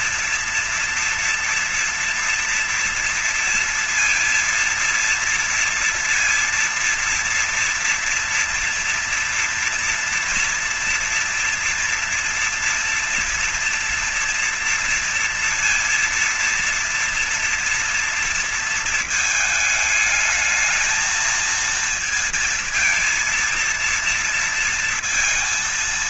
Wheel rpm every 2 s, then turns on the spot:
230, 230, 230, 230, 240, 230, 230, 230, 230, 230, 220, 230, 230.
none